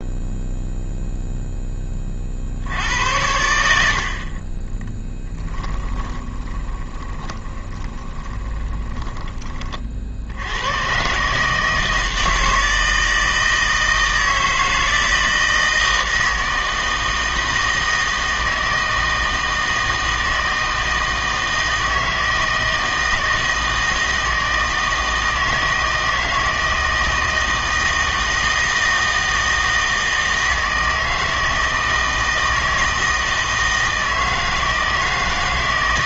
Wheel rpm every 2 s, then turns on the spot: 0, 80, 20, 20, 20, 110, 160, 160, 160, 160, 160, 160, 160, 160, 160, 160, 160, 160.
6-10